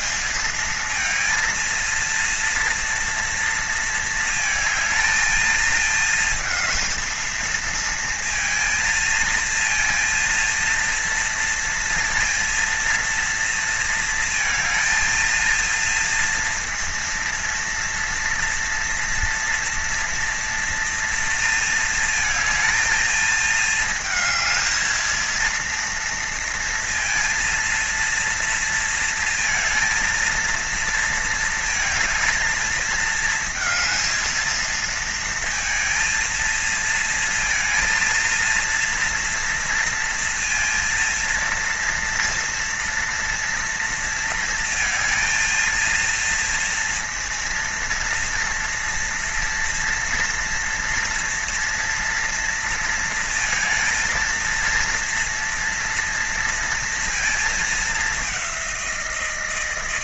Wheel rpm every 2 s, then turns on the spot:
230, 230, 220, 220, 230, 230, 230, 230, 230, 230, 230, 220, 220, 230, 230, 230, 220, 230, 230, 230, 230, 230, 230, 230, 240, 230, 230, 230, 230, 180.
none